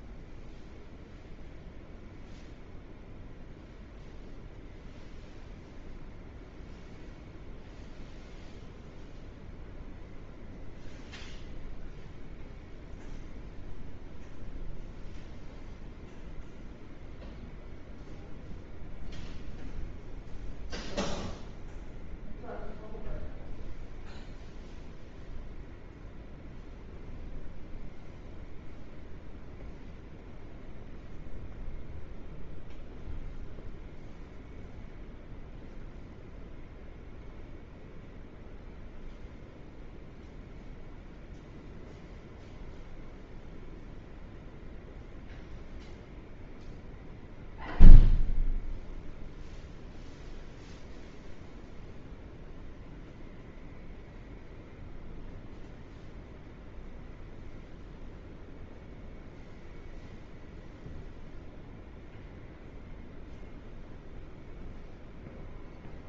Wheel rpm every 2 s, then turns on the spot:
0, 0, 0, 0, 0, 0, 0, 0, 0, 0, 0, 0, 0, 0, 0, 0, 0, 0, 0, 0, 0, 0, 0, 0, 0, 0, 0, 0, 0, 0, 0, 0, 0.
none